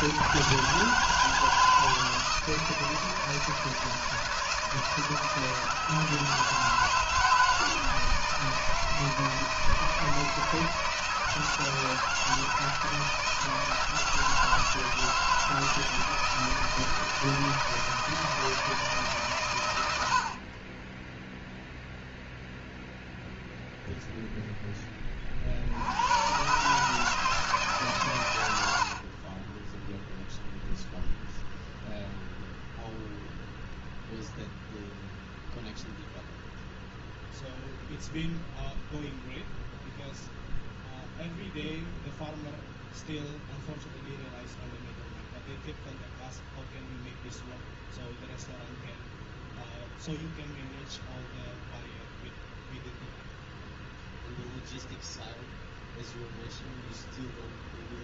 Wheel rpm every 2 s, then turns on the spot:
160, 160, 160, 160, 160, 160, 170, 160, 160, 160, 30, 0, 10, 140, 80, 0, 0, 0, 0, 0, 0, 0, 0, 0, 0, 0, 0, 0, 0.
none